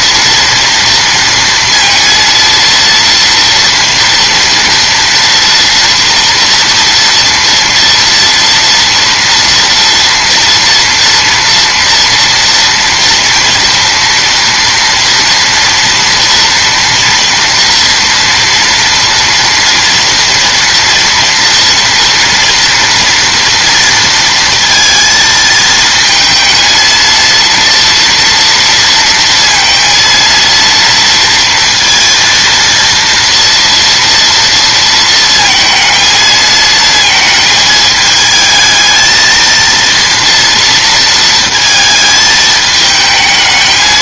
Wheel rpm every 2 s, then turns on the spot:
230, 230, 240, 230, 230, 230, 230, 230, 230, 230, 230, 230, 230, 230, 230, 230, 230, 230, 220, 220, 230, 220.
none